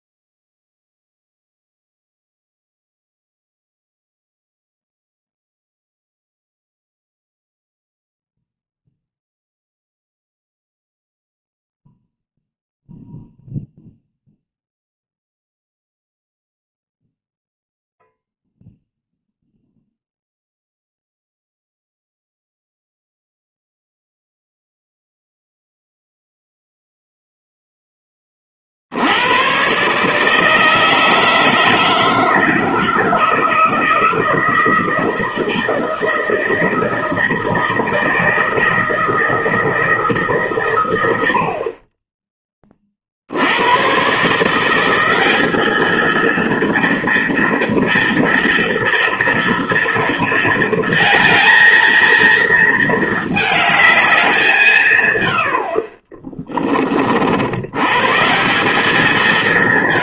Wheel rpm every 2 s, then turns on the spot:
0, 0, 0, 0, 0, 0, 0, 0, 0, 0, 0, 0, 0, 0, 20, 150, 160, 160, 160, 160, 150, 20, 130, 220, 230, 230, 230, 200, 30, 130.
none